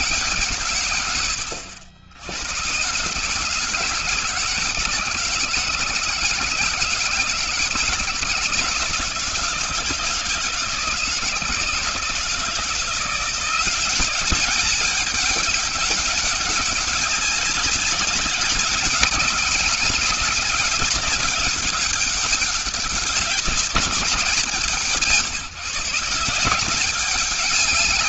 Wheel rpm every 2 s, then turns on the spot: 130, 110, 170, 160, 160, 160, 160, 190, 200, 200, 200, 200, 170, 180.
none